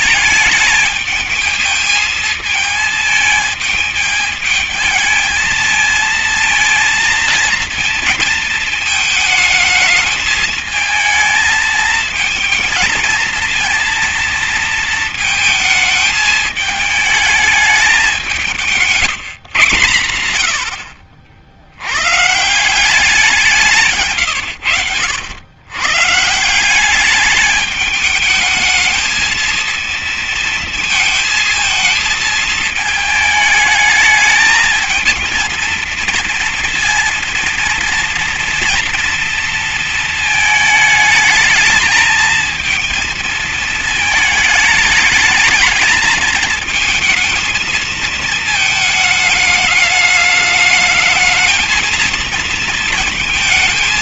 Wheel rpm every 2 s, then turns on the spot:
220, 220, 210, 230, 230, 210, 220, 230, 220, 180, 100, 150, 110, 160, 210, 230, 220, 220, 230, 230, 220, 230, 220, 220, 220, 210, 230.
none